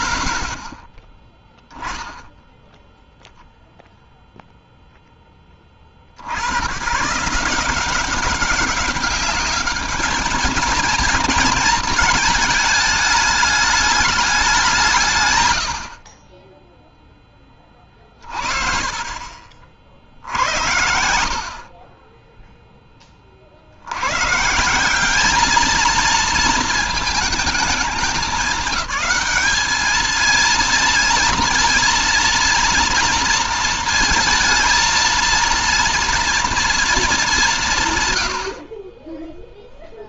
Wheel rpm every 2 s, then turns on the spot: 10, 0, 10, 150, 210, 230, 210, 120, 20, 30, 50, 40, 210, 210, 200, 230, 230, 230, 190, 10.
none